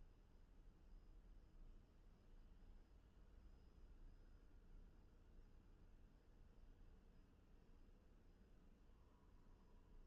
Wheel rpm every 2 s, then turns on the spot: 0, 0, 0, 0, 0.
none